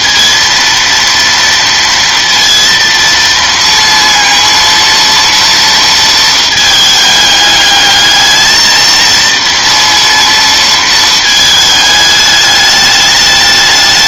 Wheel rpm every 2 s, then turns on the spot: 230, 230, 230, 220, 220, 230, 210.
none